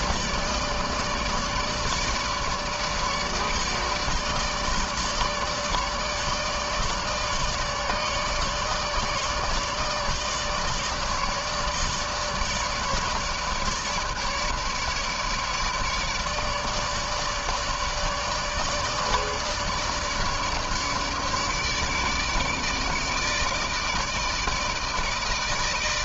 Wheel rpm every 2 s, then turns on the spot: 150, 150, 150, 150, 150, 150, 150, 150, 150, 150, 150, 150, 160.
none